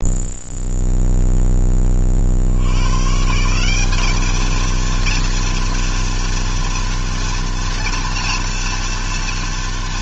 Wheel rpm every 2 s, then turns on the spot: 0, 90, 220, 230, 230.
none